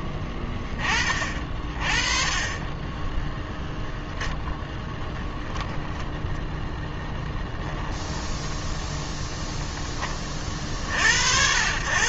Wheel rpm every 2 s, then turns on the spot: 20, 20, 10, 0, 0, 50.
none